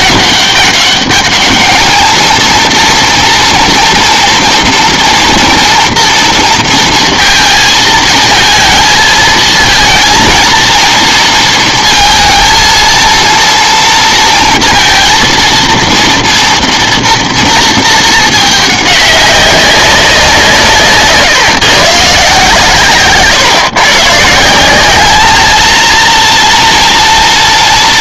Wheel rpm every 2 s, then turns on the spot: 200, 230, 230, 230, 220, 230, 230, 230, 230, 210, 150, 140, 190, 230.
none